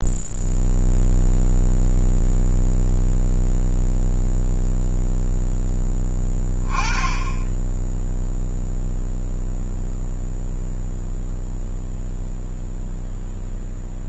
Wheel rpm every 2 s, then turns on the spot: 0, 0, 0, 20, 0, 0, 0.
none